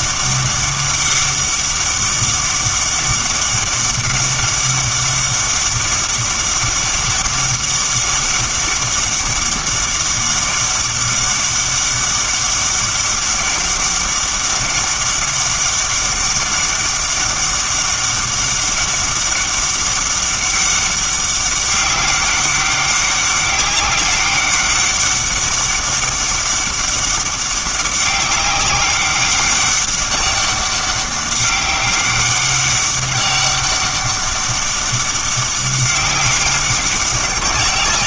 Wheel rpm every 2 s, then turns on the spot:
200, 190, 200, 200, 200, 200, 200, 200, 200, 200, 200, 200, 200, 200, 200, 200, 200, 200, 190.
none